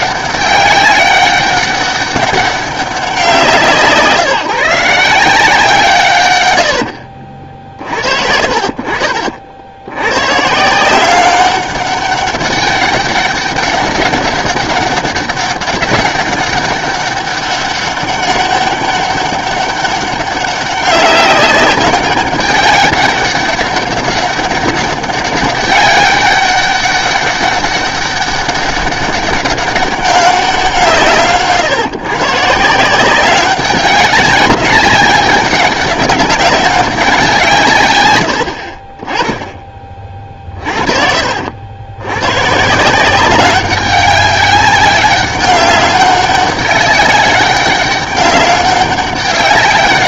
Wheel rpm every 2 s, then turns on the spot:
200, 200, 170, 80, 50, 160, 200, 200, 200, 200, 190, 200, 200, 200, 200, 170, 160, 190, 190, 60, 40, 150, 200, 200, 200.
none